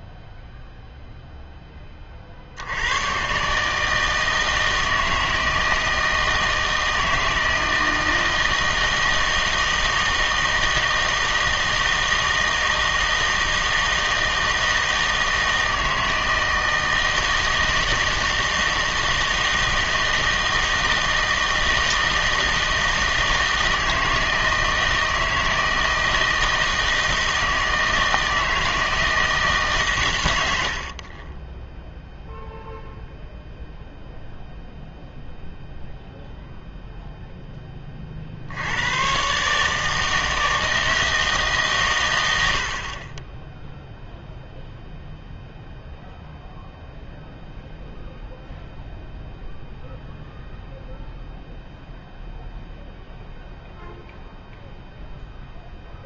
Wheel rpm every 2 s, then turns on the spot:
0, 70, 160, 160, 160, 160, 160, 160, 160, 160, 160, 160, 160, 160, 160, 80, 0, 0, 0, 80, 160, 70, 0, 0, 0, 0, 0, 0.
none